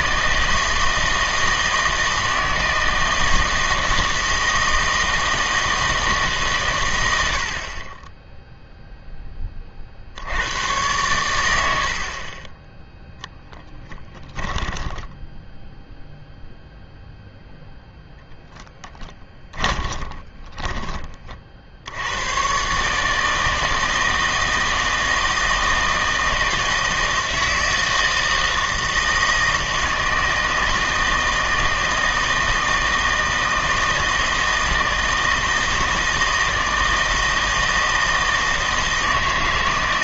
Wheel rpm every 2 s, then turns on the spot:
160, 160, 160, 120, 0, 100, 10, 10, 0, 10, 20, 130, 160, 160, 160, 160, 160, 160, 160, 160.
14-16 18-22